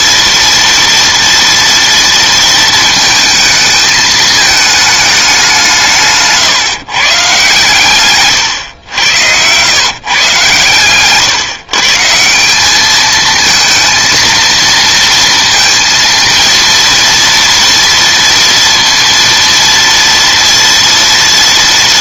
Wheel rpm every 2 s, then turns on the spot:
230, 230, 220, 150, 110, 130, 200, 230, 230, 230, 240.
8-10